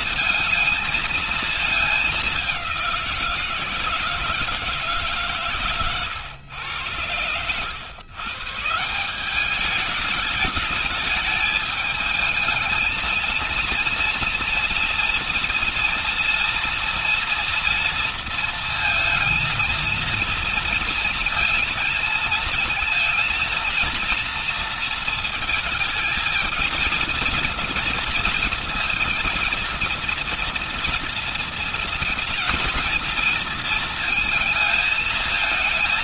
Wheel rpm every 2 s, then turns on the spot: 220, 190, 160, 120, 140, 210, 220, 230, 230, 230, 230, 220, 230, 230, 230, 230, 230, 220.
none